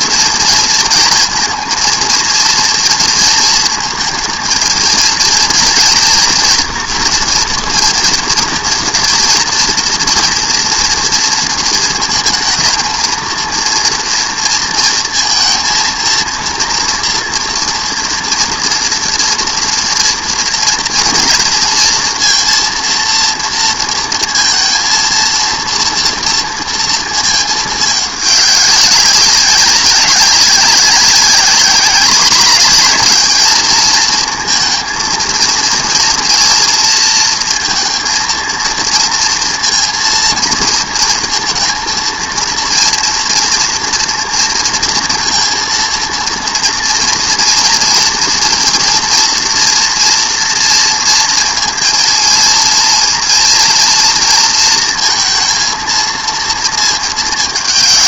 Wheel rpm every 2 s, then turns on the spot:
230, 230, 230, 230, 230, 230, 230, 230, 230, 240, 230, 230, 230, 230, 200, 190, 210, 230, 230, 230, 230, 230, 230, 230, 230, 230, 230, 230, 230.
none